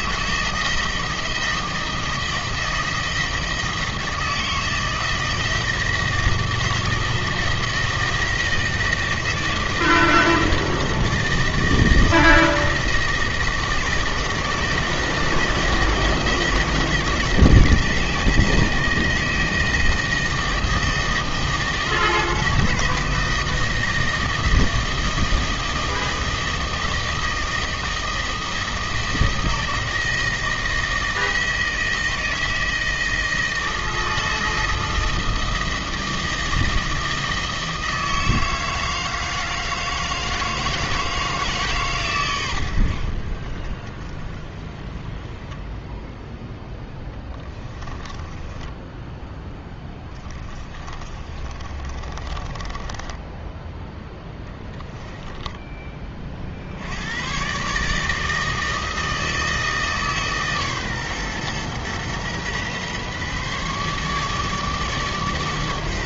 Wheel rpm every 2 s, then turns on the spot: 160, 160, 160, 160, 160, 160, 160, 160, 160, 160, 160, 160, 160, 160, 160, 160, 160, 160, 160, 160, 160, 90, 20, 0, 10, 30, 20, 10, 70, 160, 140, 130, 150.
48-56